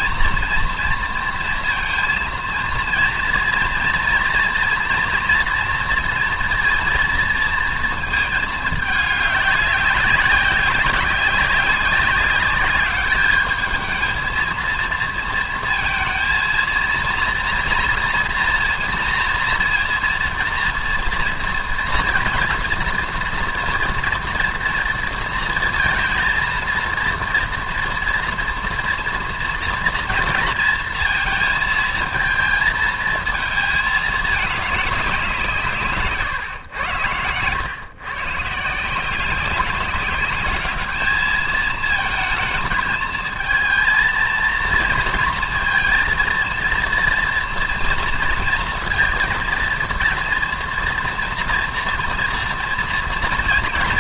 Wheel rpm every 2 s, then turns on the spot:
230, 230, 230, 230, 210, 190, 200, 230, 230, 240, 230, 230, 230, 230, 230, 230, 230, 200, 110, 160, 210, 220, 230, 230, 230, 230, 230.
none